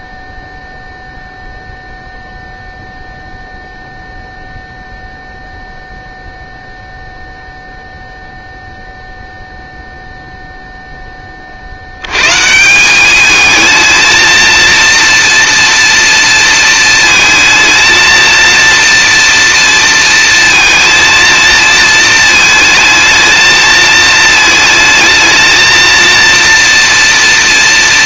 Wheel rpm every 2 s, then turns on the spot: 0, 0, 0, 0, 0, 50, 220, 240, 230, 230, 220, 220, 220, 230.
none